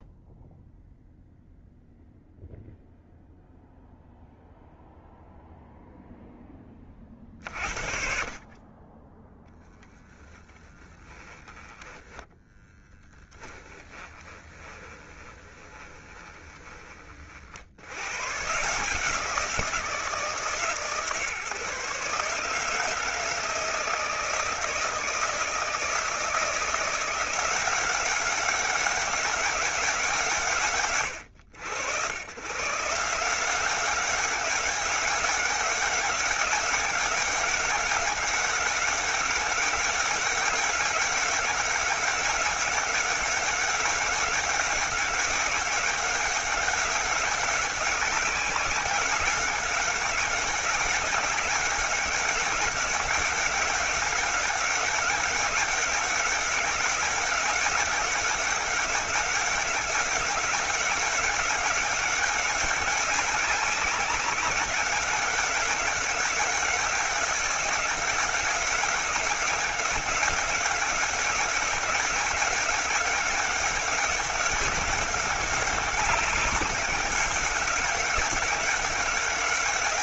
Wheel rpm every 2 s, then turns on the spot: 0, 0, 0, 40, 20, 10, 10, 20, 40, 160, 140, 160, 160, 170, 200, 120, 160, 190, 200, 200, 200, 200, 200, 190, 190, 190, 200, 190, 200, 200, 200, 200, 200, 200, 200, 190, 200, 200, 200, 190.
10-16